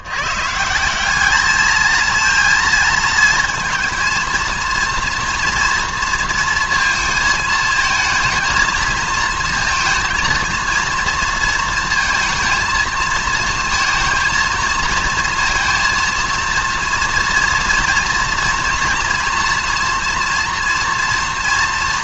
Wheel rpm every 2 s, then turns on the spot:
180, 230, 230, 230, 220, 230, 220, 220, 230, 230, 240.
none